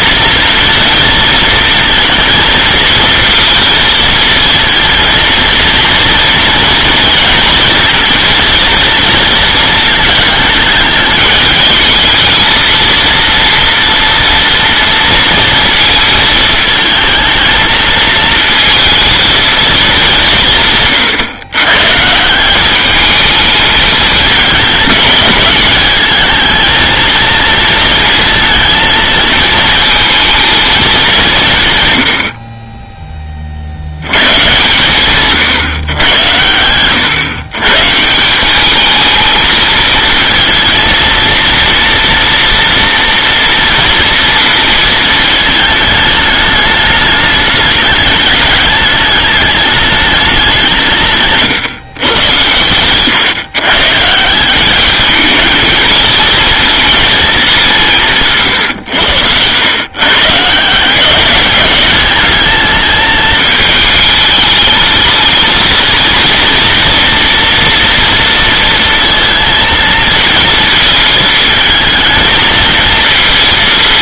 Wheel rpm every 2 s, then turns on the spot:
230, 220, 230, 230, 230, 220, 230, 230, 220, 230, 130, 210, 210, 220, 220, 190, 10, 130, 110, 210, 230, 240, 220, 210, 210, 150, 120, 210, 220, 100, 170, 220, 220, 230, 230, 220, 220.
none